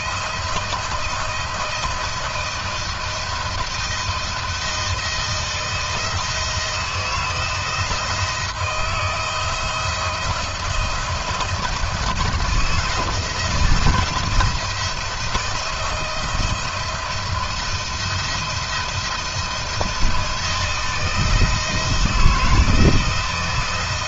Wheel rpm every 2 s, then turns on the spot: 170, 170, 160, 160, 170, 170, 170, 170, 160, 170, 170, 160.
none